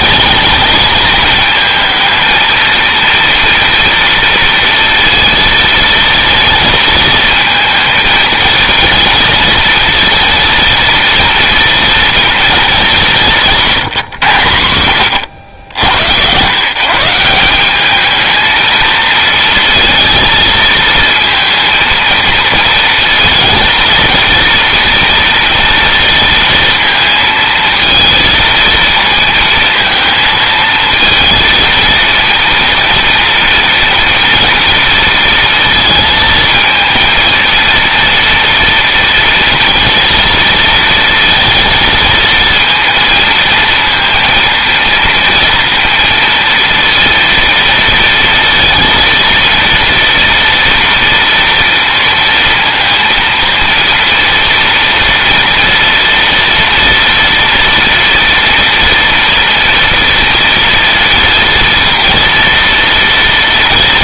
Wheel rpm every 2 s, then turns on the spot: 220, 230, 230, 220, 230, 230, 200, 100, 150, 220, 230, 230, 230, 230, 230, 230, 230, 230, 230, 230, 230, 230, 230, 230, 230, 240, 230, 230, 230, 230, 230, 230.
none